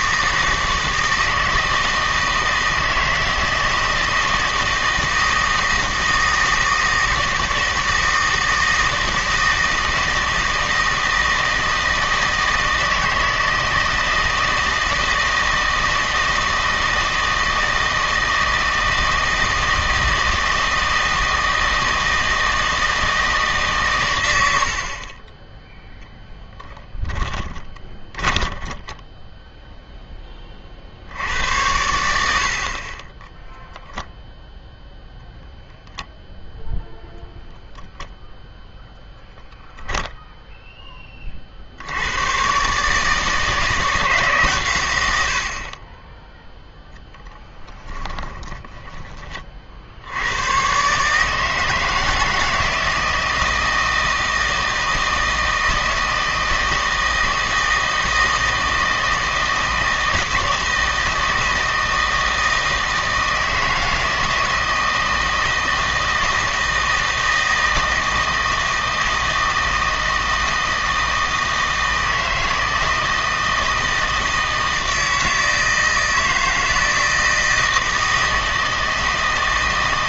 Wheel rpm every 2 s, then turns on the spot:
160, 160, 160, 160, 160, 160, 160, 160, 160, 160, 160, 160, 50, 20, 20, 50, 50, 10, 0, 0, 10, 140, 120, 0, 10, 130, 160, 160, 160, 160, 160, 160, 160, 160, 160, 160, 160, 160, 160, 160.
26-30 34-36 48-50